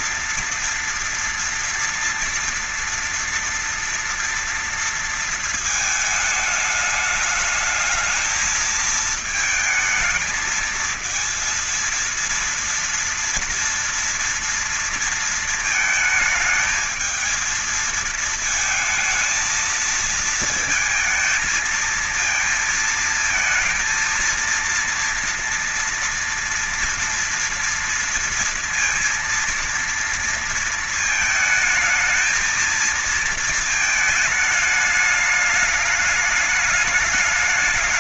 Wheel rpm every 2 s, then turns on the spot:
230, 230, 230, 210, 220, 220, 230, 230, 220, 220, 220, 220, 230, 230, 230, 230, 220, 210, 210.
none